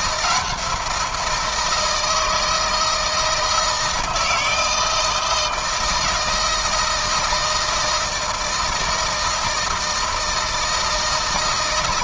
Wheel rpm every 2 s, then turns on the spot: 170, 160, 160, 160, 160, 170.
none